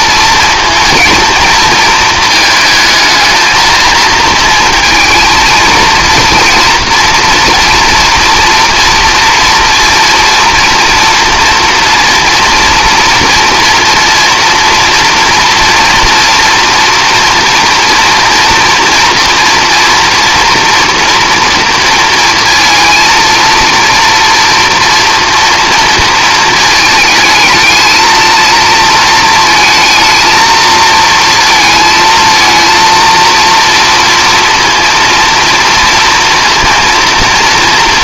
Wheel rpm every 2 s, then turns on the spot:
230, 220, 220, 230, 230, 230, 230, 230, 230, 240, 240, 230, 230, 230, 230, 230, 230, 230, 230.
none